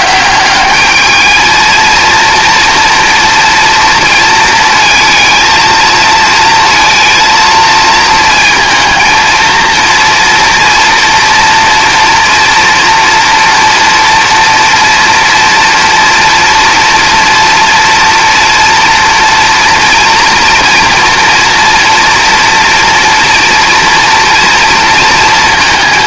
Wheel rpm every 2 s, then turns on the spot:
210, 230, 230, 230, 230, 230, 230, 230, 240, 240, 230, 230, 230.
none